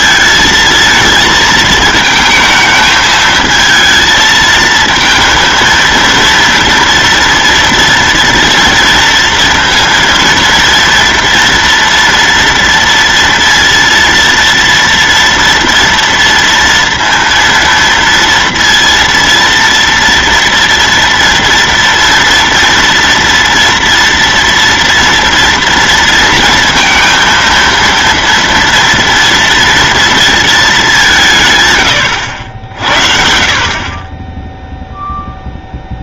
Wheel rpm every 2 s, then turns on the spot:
220, 220, 220, 230, 230, 230, 230, 230, 230, 230, 240, 230, 240, 230, 240, 200, 70, 0.
none